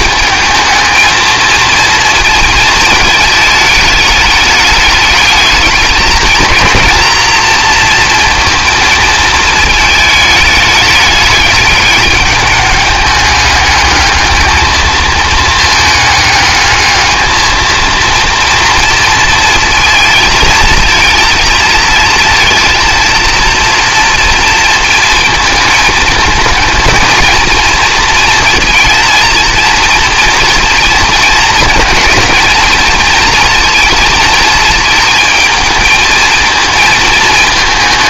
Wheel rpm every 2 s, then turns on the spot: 220, 220, 210, 230, 220, 210, 210, 220, 210, 230, 220, 230, 230, 220, 230, 230, 220, 220, 220.
none